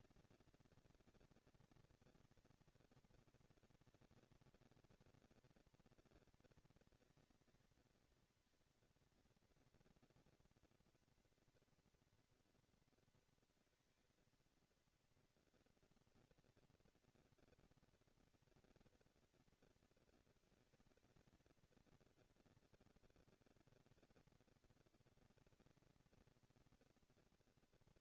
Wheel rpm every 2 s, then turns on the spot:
230, 230, 230, 220, 220, 230, 230, 230, 230, 230, 230, 230, 230, 230.
none